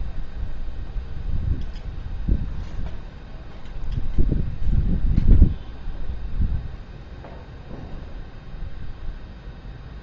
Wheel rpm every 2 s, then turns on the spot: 0, 0, 0, 0, 0.
none